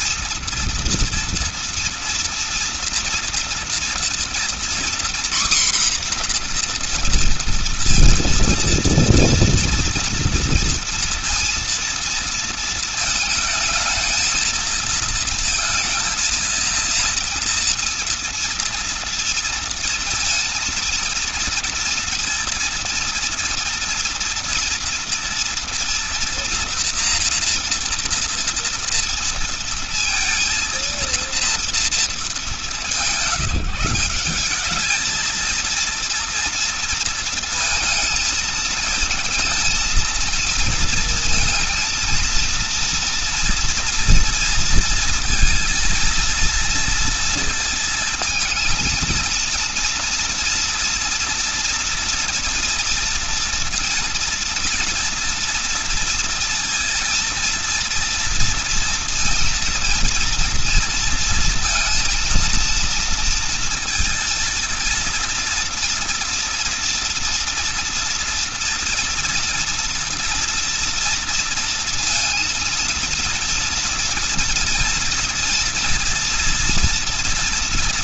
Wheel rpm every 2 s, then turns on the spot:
230, 230, 240, 240, 230, 240, 230, 230, 230, 240, 230, 230, 230, 240, 230, 230, 190, 200, 230, 220, 230, 230, 230, 230, 230, 230, 240, 230, 230, 230, 230, 230, 230, 230, 230, 230, 230, 230, 230.
none